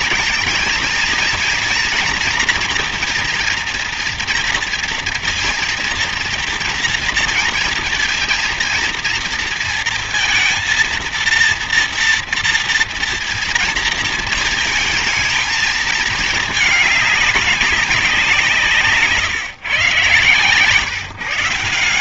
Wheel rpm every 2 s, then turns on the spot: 230, 240, 230, 230, 230, 230, 230, 220, 220, 170, 140.
none